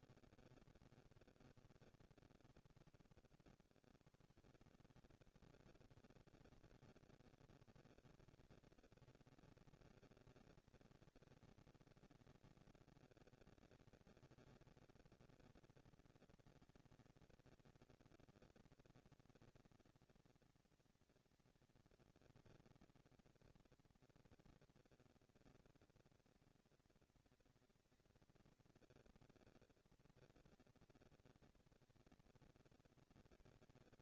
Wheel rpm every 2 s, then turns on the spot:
160, 100, 140, 230, 230, 230, 230, 220, 230, 230, 230, 240, 230, 230, 230, 230, 230.
none